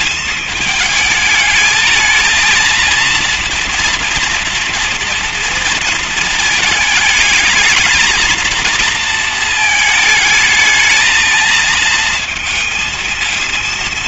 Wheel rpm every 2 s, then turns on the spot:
220, 220, 230, 220, 230, 220, 220.
none